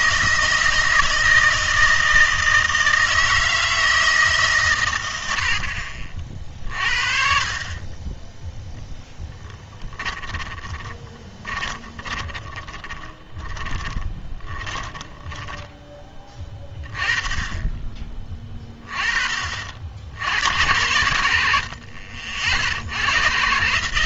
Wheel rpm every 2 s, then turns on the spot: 160, 160, 120, 50, 0, 20, 20, 10, 20, 20, 90, 70.
10-14